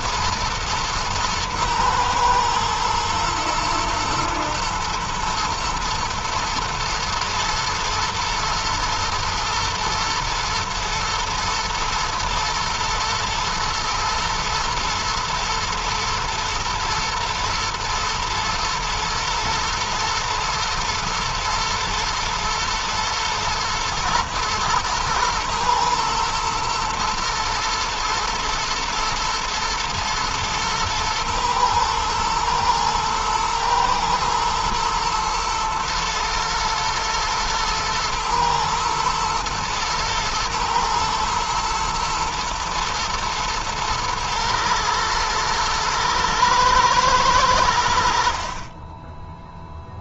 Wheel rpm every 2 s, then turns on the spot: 110, 110, 120, 110, 110, 120, 110, 110, 120, 120, 110, 120, 110, 110, 110, 110, 120, 110, 120, 110, 110, 110, 110, 110, 20.
none